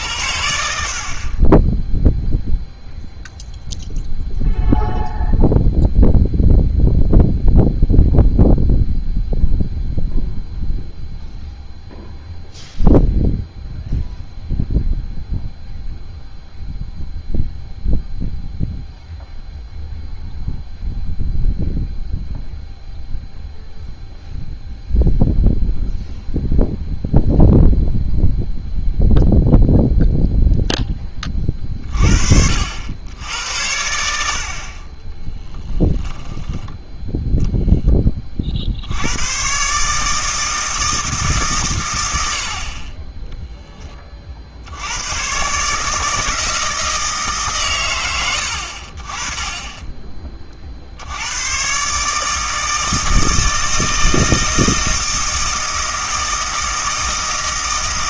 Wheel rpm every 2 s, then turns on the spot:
60, 0, 0, 0, 0, 0, 0, 0, 0, 0, 0, 0, 0, 0, 0, 0, 70, 40, 10, 60, 160, 40, 80, 160, 60, 60, 160, 160, 160.
none